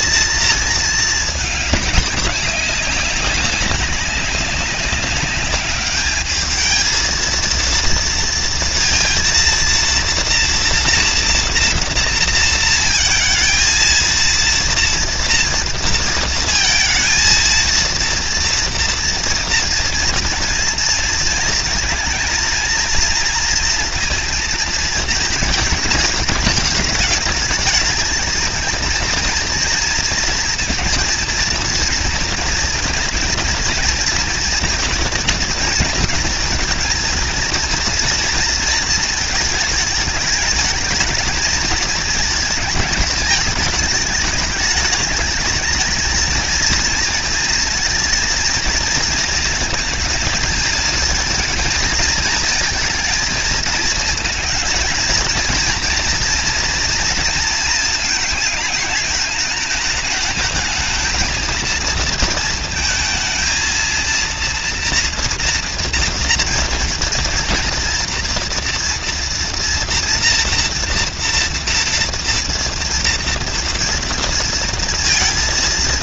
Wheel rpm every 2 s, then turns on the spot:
230, 210, 190, 200, 230, 230, 230, 230, 230, 230, 230, 230, 230, 220, 210, 230, 230, 230, 230, 230, 220, 230, 210, 220, 230, 230, 220, 220, 230, 230, 220, 230, 230, 230, 230, 230, 230, 230.
none